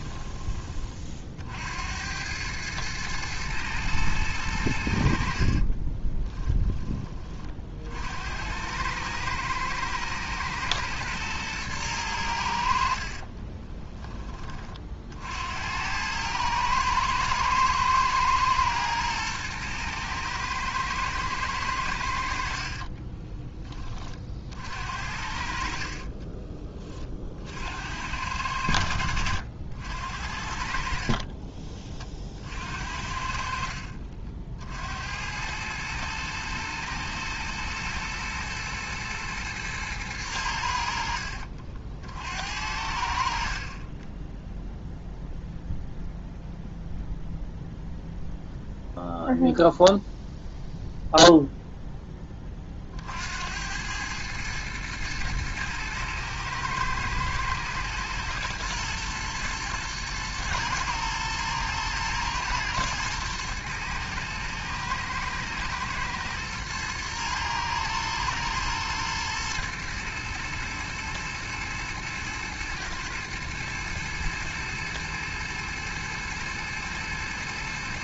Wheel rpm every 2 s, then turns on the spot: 40, 110, 80, 20, 100, 120, 60, 50, 110, 110, 110, 30, 50, 40, 80, 50, 60, 70, 110, 120, 70, 70, 0, 0, 0, 0, 40, 110, 110, 120, 110, 110, 110, 110, 110, 110, 120, 120, 110.
22-24